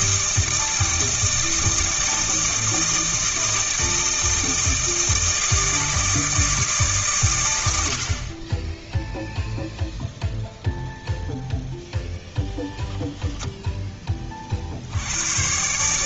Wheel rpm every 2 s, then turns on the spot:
160, 160, 160, 150, 10, 0, 10, 70.
none